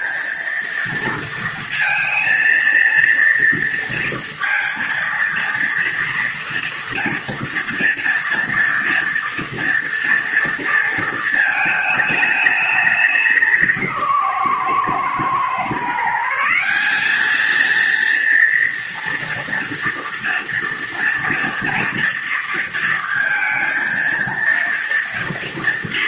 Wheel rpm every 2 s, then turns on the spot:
230, 230, 230, 230, 230, 230, 210, 130, 180, 230, 230, 230, 230.
none